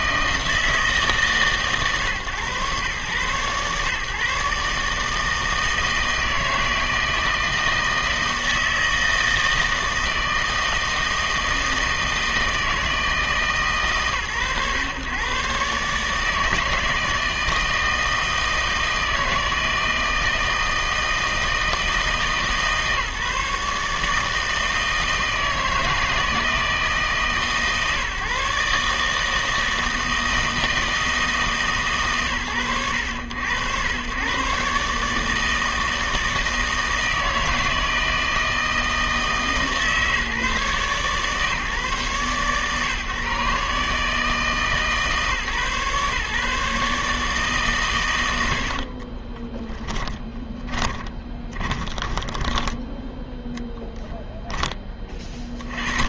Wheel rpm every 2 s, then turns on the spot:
160, 120, 150, 160, 160, 160, 160, 120, 160, 160, 160, 150, 160, 150, 150, 160, 90, 140, 160, 160, 140, 130, 150, 150, 60, 20, 20, 20.
50-54